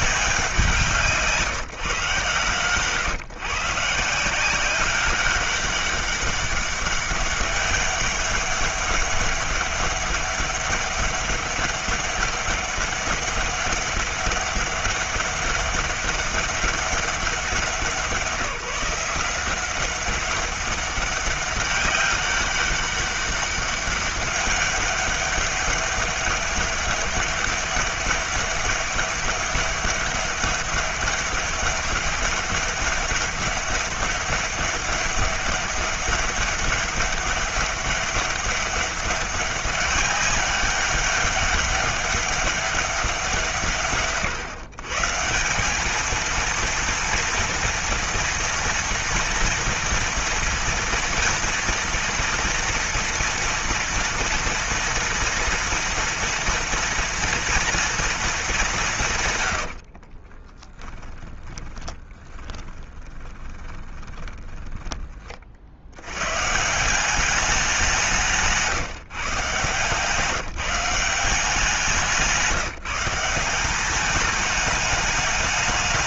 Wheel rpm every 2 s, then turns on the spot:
180, 130, 190, 200, 200, 200, 200, 200, 200, 170, 200, 200, 200, 200, 200, 200, 200, 200, 200, 200, 200, 170, 140, 230, 230, 230, 230, 230, 230, 170, 10, 20, 20, 170, 150, 180, 170, 210.
60-64